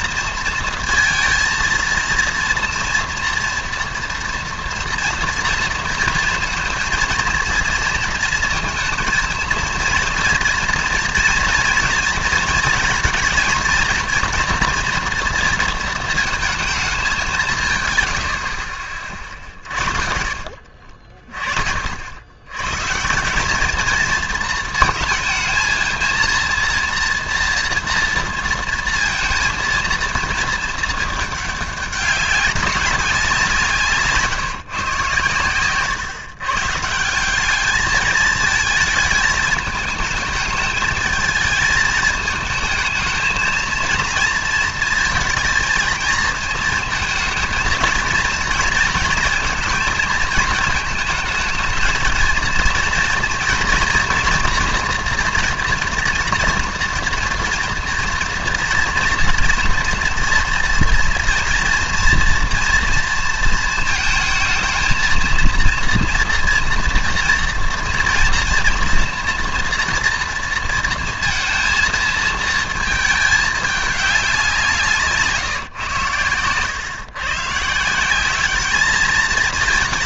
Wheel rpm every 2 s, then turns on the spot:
230, 230, 230, 230, 230, 230, 230, 230, 220, 50, 40, 120, 220, 230, 230, 220, 200, 150, 140, 220, 220, 220, 230, 230, 230, 220, 230, 240, 230, 230, 230, 230, 220, 240, 230, 230, 220, 180, 120, 210.
none